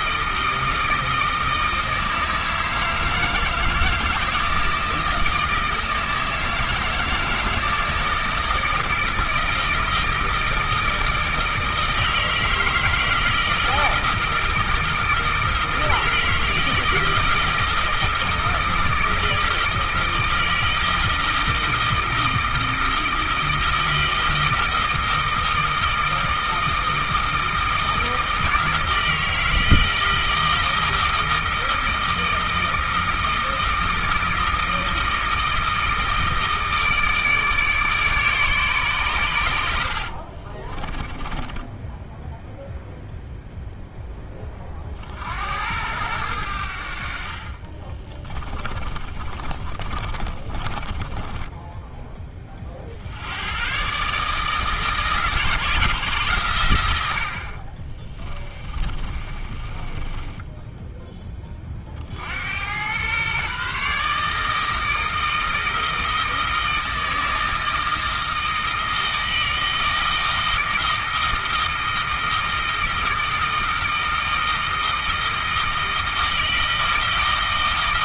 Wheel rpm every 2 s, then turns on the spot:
160, 160, 160, 160, 160, 160, 160, 160, 160, 160, 160, 160, 160, 160, 160, 160, 160, 160, 160, 130, 20, 0, 50, 70, 30, 20, 60, 150, 90, 30, 10, 110, 160, 160, 160, 160, 160, 160, 160.
40-42 48-52 58-60